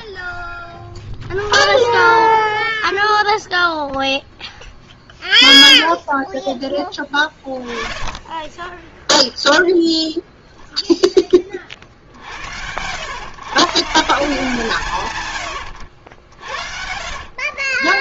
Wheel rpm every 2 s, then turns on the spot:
0, 0, 0, 10, 10, 0, 70, 160, 70.
none